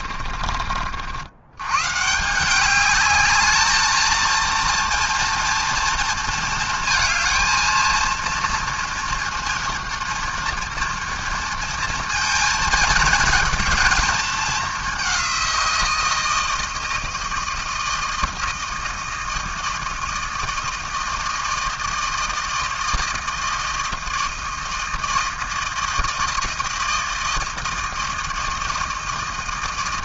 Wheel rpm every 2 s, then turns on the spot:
40, 170, 230, 230, 230, 240, 230, 210, 160, 160, 160, 160, 160, 160, 160.
0-2